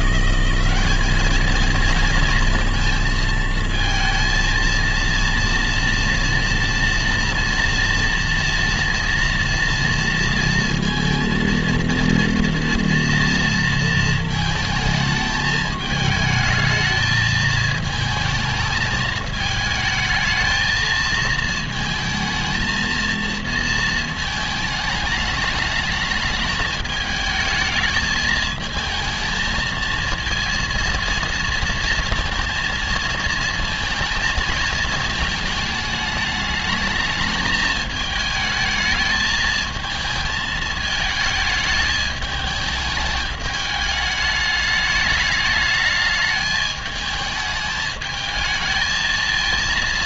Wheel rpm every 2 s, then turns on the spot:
190, 230, 230, 230, 230, 230, 230, 220, 220, 220, 220, 220, 220, 220, 220, 230, 230, 220, 210, 220, 220, 220, 210, 210, 220.
none